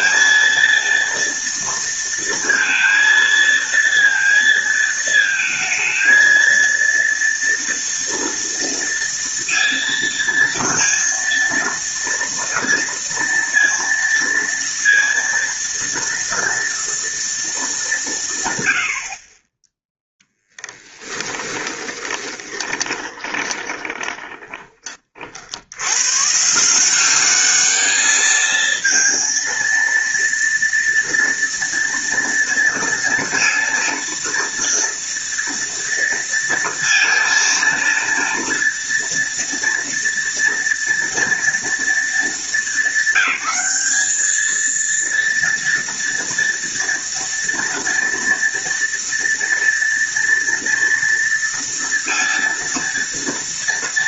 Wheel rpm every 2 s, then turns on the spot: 230, 230, 230, 230, 230, 230, 230, 230, 230, 130, 10, 20, 20, 160, 220, 230, 230, 230, 230, 230, 230, 210, 220, 230, 230, 230, 230.
20-24